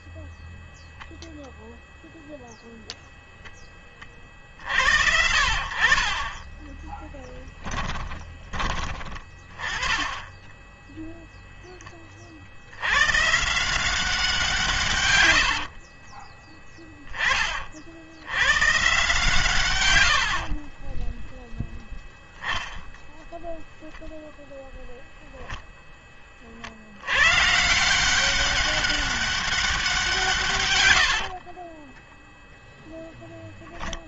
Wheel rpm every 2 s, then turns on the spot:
0, 0, 50, 10, 30, 10, 70, 150, 20, 120, 40, 10, 0, 50, 200, 130, 0.
6-8 10-12 16-18 20-22